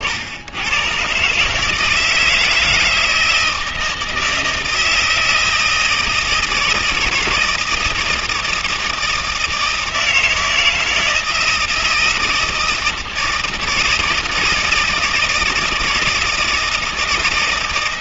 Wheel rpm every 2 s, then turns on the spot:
90, 160, 160, 160, 160, 160, 160, 160, 160.
none